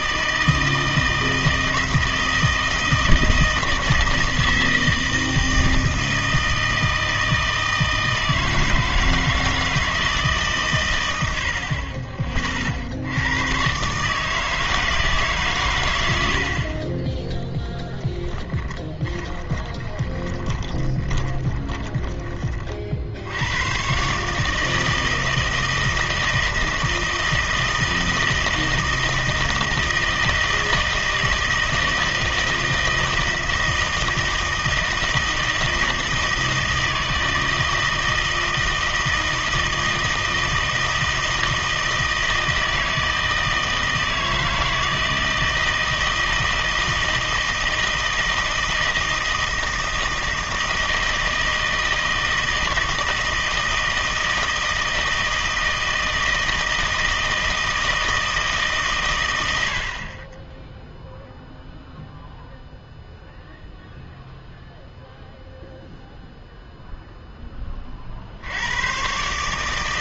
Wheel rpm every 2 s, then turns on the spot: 160, 160, 160, 160, 160, 130, 50, 160, 50, 10, 20, 30, 150, 160, 160, 160, 160, 160, 160, 160, 160, 160, 160, 160, 160, 160, 160, 160, 160, 160, 0, 0, 0, 0, 80.
18-22